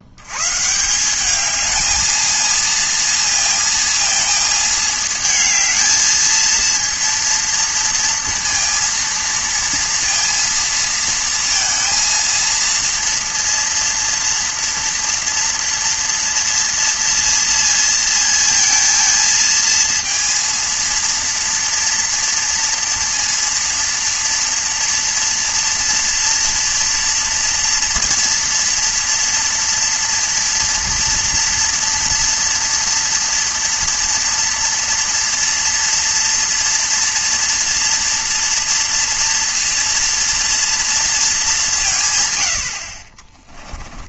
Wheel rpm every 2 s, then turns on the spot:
190, 230, 220, 230, 230, 230, 230, 230, 230, 230, 230, 230, 240, 230, 230, 230, 240, 240, 230, 230, 220, 40.
none